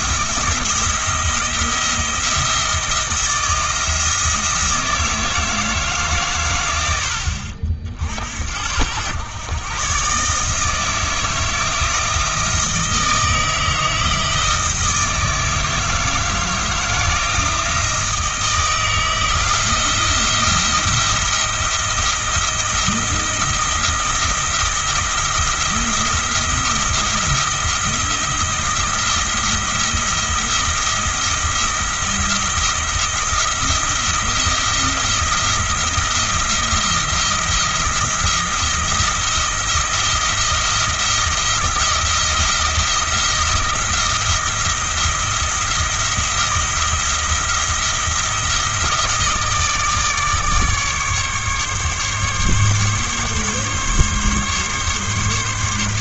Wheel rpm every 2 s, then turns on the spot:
170, 170, 160, 80, 90, 160, 160, 160, 160, 160, 170, 170, 170, 170, 170, 170, 170, 170, 170, 170, 170, 170, 170, 170, 170, 150, 140, 140.
none